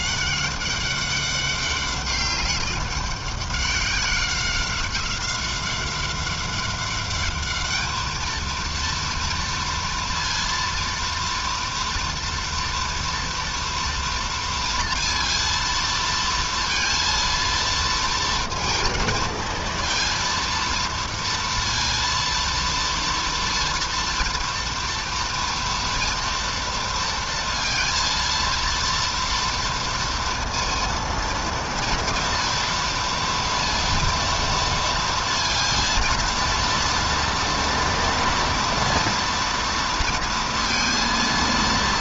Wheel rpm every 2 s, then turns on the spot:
200, 190, 190, 210, 230, 240, 230, 230, 230, 230, 230, 230, 230, 230, 230, 230, 230, 230, 230, 230, 230.
none